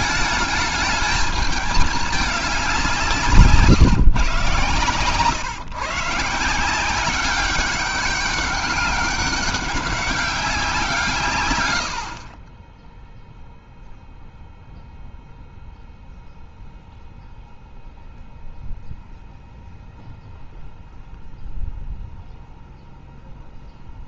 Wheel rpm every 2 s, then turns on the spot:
210, 190, 130, 180, 200, 170, 10, 0, 0, 0, 0, 0.
none